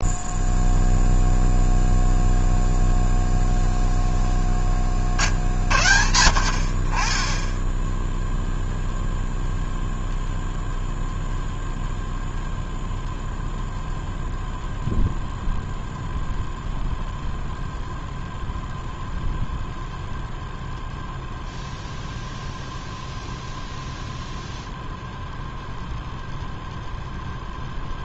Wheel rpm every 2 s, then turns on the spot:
0, 0, 40, 30, 0, 0, 0, 0, 0, 0, 0, 0, 0, 0.
none